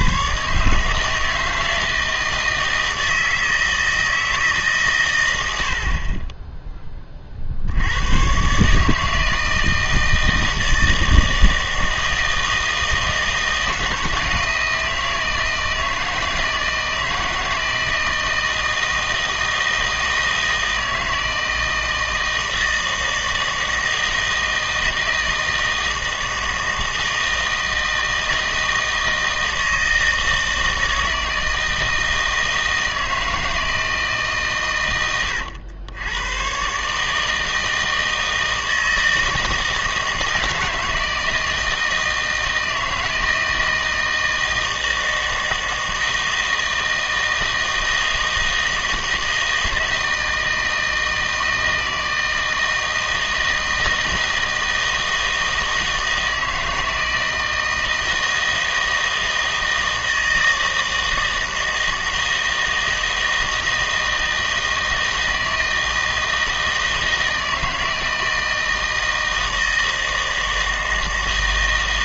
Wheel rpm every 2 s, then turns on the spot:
150, 160, 150, 10, 140, 160, 160, 170, 160, 160, 160, 160, 160, 160, 160, 160, 160, 120, 130, 160, 160, 160, 160, 160, 160, 160, 160, 160, 160, 160, 160, 160, 160, 160, 160, 160.
none